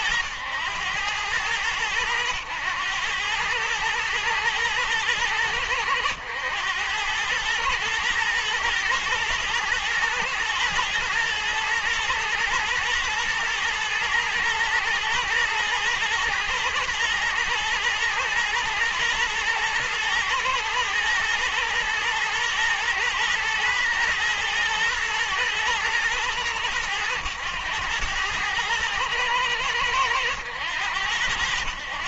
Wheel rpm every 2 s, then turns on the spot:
100, 110, 110, 100, 120, 120, 110, 110, 120, 110, 110, 110, 110, 110, 110, 100.
none